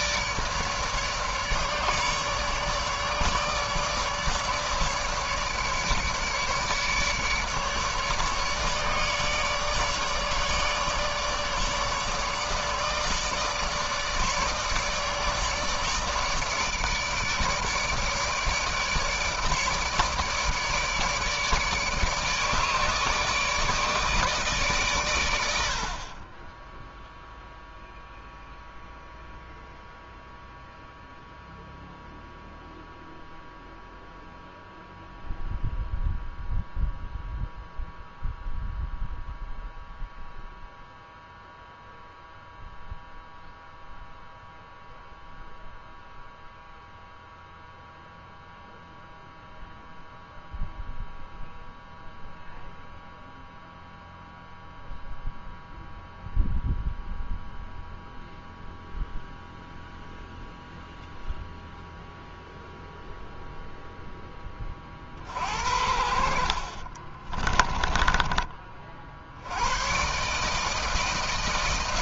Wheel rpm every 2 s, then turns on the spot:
150, 150, 150, 150, 150, 150, 150, 150, 150, 160, 150, 150, 150, 30, 0, 0, 0, 0, 0, 0, 0, 0, 0, 0, 0, 0, 0, 0, 0, 0, 0, 0, 10, 50, 20, 130.
none